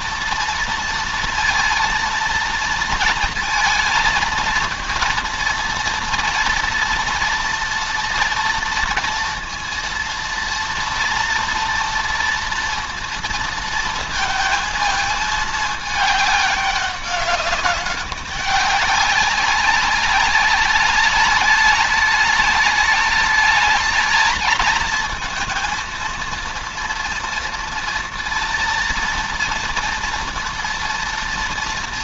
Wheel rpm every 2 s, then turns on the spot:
230, 230, 230, 230, 230, 230, 230, 230, 200, 200, 200, 210, 220, 230, 230, 230.
none